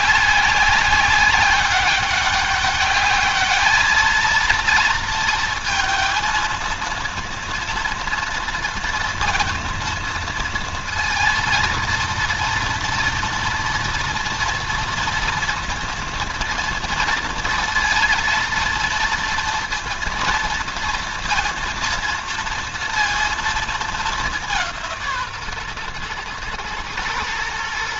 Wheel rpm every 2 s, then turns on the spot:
190, 200, 230, 230, 230, 230, 230, 230, 240, 230, 230, 230, 170, 110.
none